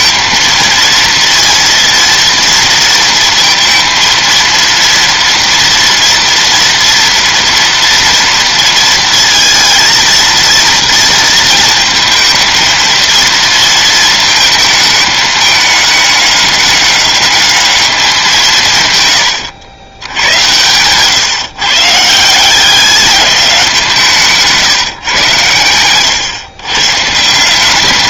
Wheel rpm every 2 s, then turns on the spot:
230, 230, 230, 230, 230, 230, 220, 220, 210, 160, 100, 180, 150, 130.
20-22